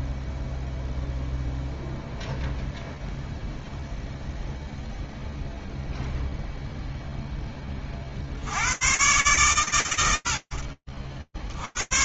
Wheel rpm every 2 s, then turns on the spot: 0, 0, 0, 0, 120, 80.
none